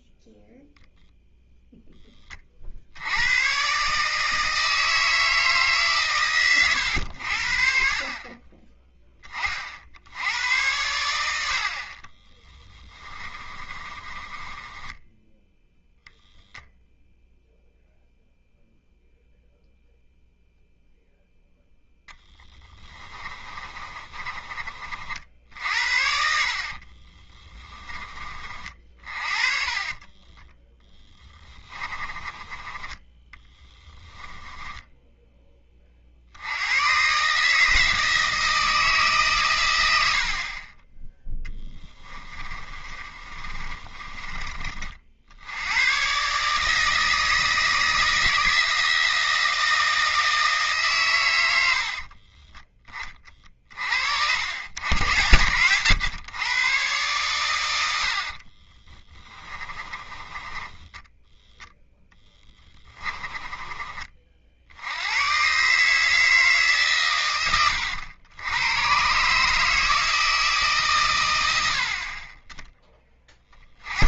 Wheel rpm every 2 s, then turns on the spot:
0, 70, 160, 110, 20, 100, 20, 10, 0, 0, 0, 20, 50, 30, 40, 20, 10, 10, 140, 140, 10, 30, 60, 160, 160, 120, 20, 90, 120, 30, 10, 20, 90, 150, 110, 140, 20.
12-16 22-24 26-34 42-44 58-64